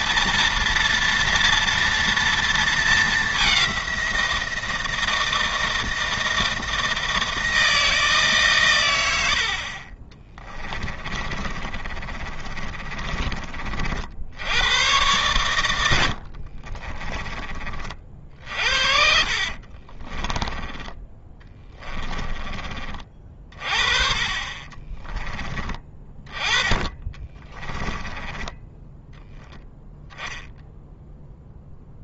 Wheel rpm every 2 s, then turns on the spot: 230, 220, 160, 160, 110, 20, 30, 100, 30, 60, 20, 30, 30, 20, 10, 0.
10-14 16-22 24-26